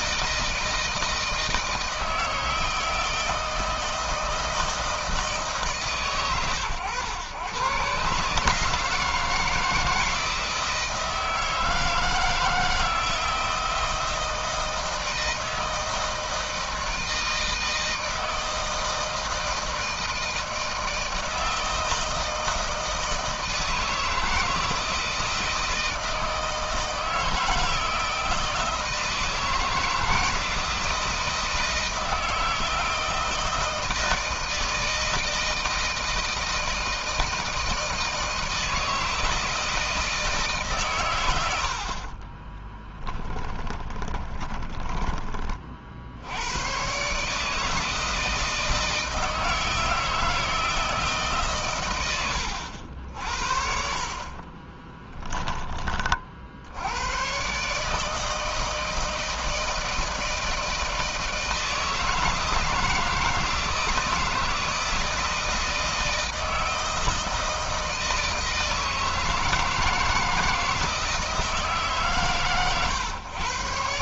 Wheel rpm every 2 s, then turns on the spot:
160, 160, 160, 110, 160, 160, 160, 160, 160, 160, 160, 160, 160, 160, 160, 160, 160, 160, 160, 160, 130, 10, 20, 130, 160, 160, 80, 20, 80, 160, 160, 160, 160, 160, 160, 160, 130.
42-44 54-56